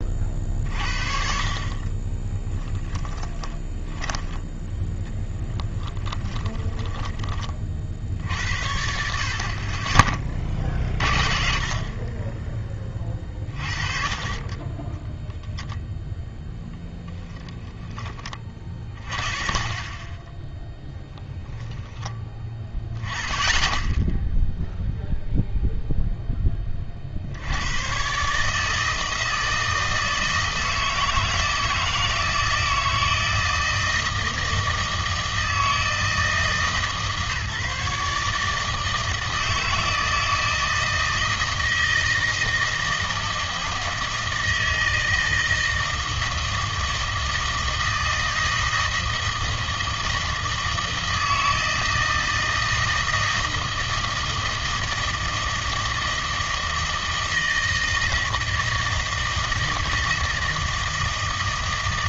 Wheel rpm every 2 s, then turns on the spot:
50, 20, 10, 10, 70, 40, 20, 20, 10, 40, 10, 10, 0, 20, 150, 160, 160, 160, 160, 160, 160, 160, 160, 160, 160, 160, 160, 160, 160, 160, 160.
2-4 6-8